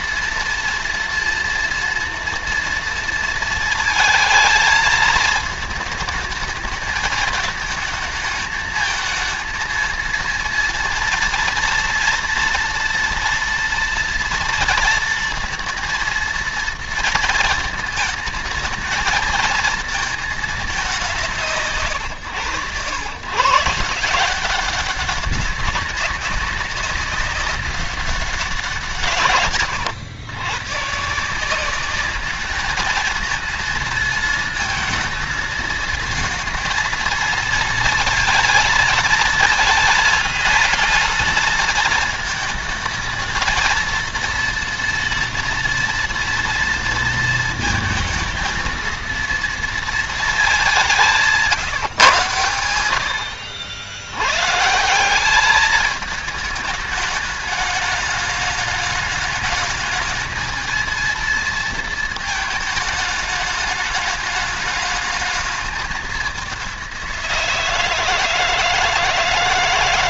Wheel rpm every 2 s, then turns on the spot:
230, 230, 220, 210, 220, 230, 230, 230, 230, 220, 170, 130, 200, 190, 150, 150, 220, 230, 230, 230, 230, 220, 230, 230, 230, 190, 90, 180, 210, 210, 220, 220, 210, 180, 160.
none